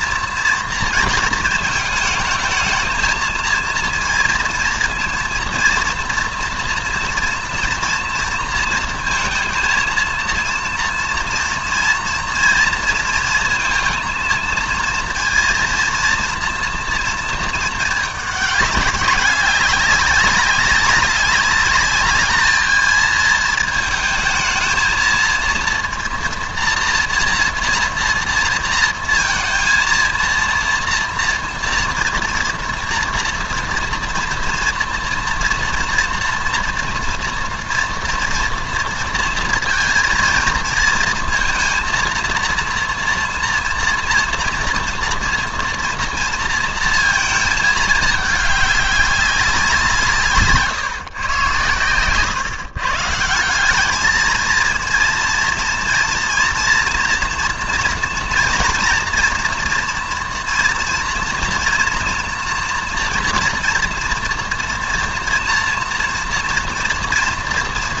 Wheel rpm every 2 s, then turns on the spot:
230, 220, 230, 240, 230, 230, 230, 230, 230, 200, 200, 210, 230, 230, 230, 230, 240, 230, 230, 230, 230, 230, 230, 230, 210, 140, 130, 230, 240, 230, 230, 230, 230, 240.
none